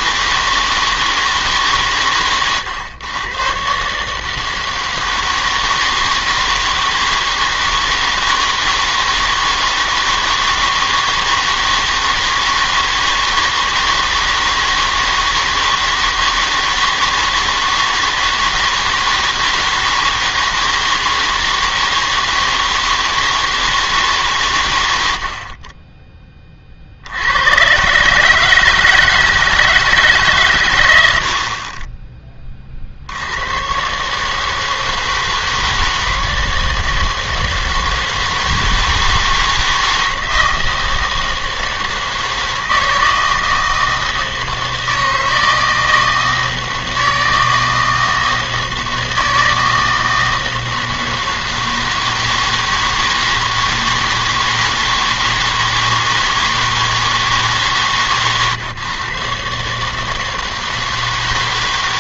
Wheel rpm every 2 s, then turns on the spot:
160, 120, 160, 160, 160, 160, 160, 160, 160, 160, 160, 160, 120, 30, 160, 120, 30, 160, 160, 160, 160, 160, 160, 160, 160, 160, 160, 160, 160, 130, 160.
none